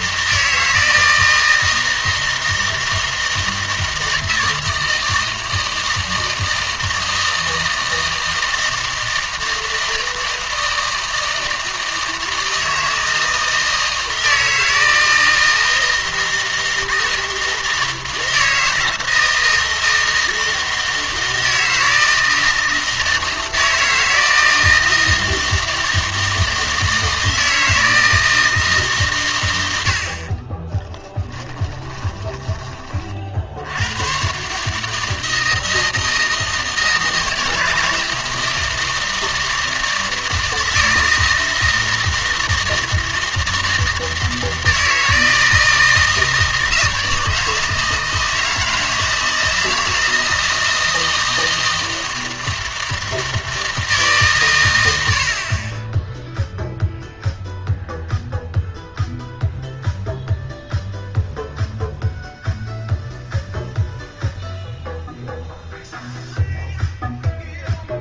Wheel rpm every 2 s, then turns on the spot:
160, 160, 160, 160, 160, 160, 160, 160, 160, 160, 160, 160, 160, 160, 150, 20, 30, 150, 160, 160, 160, 160, 160, 160, 160, 160, 160, 110, 0, 0, 0, 0, 0, 0.
30-32